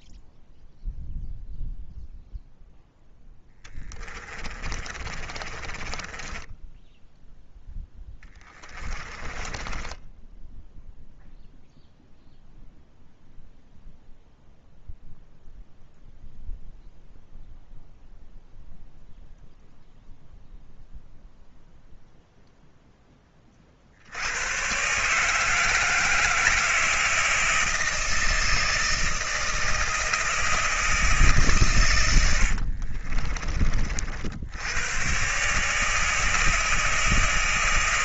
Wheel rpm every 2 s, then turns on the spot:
0, 0, 30, 10, 10, 0, 0, 0, 0, 0, 0, 10, 140, 160, 160, 160, 60, 100, 160.
4-10 32-34